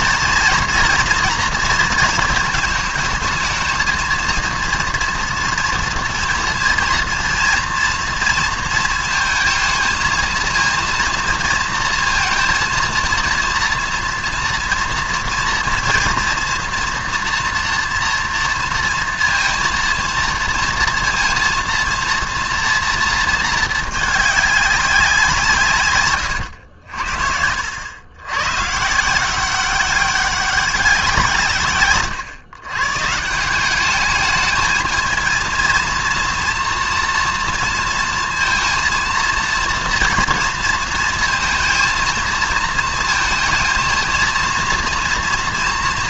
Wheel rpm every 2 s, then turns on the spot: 230, 220, 230, 230, 230, 230, 230, 230, 240, 230, 230, 230, 190, 80, 150, 180, 130, 220, 230, 230, 230, 220, 230.
none